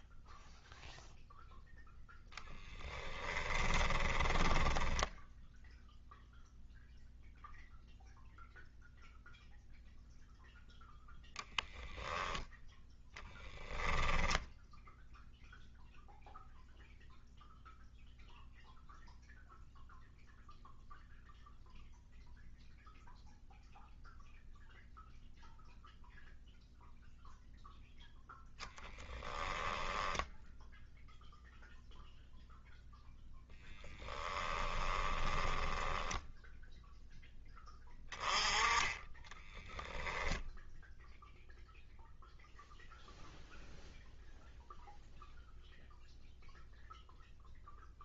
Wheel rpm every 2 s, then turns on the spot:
0, 20, 10, 0, 0, 0, 0, 0, 0, 0, 0, 0, 0, 0, 20, 0, 0, 10, 0, 20, 0, 0, 0, 0.
2-6 28-30 34-36 38-40